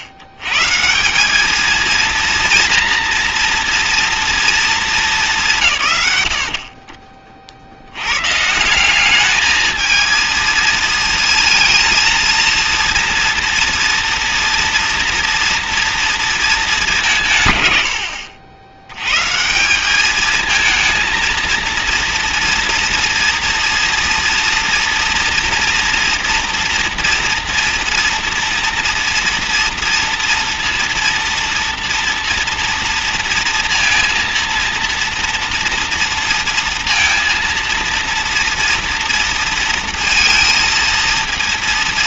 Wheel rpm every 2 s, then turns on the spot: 110, 230, 220, 60, 160, 230, 230, 230, 210, 90, 220, 230, 230, 240, 230, 240, 230, 230, 230, 230, 230.
none